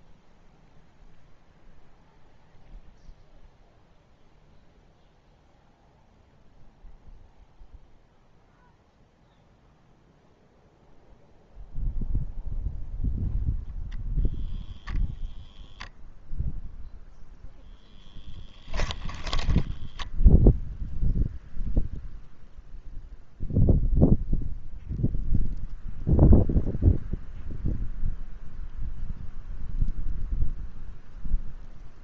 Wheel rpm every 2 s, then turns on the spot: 0, 0, 0, 0, 0, 0, 0, 0, 0, 10, 0, 0, 0, 0, 0, 0.
18-20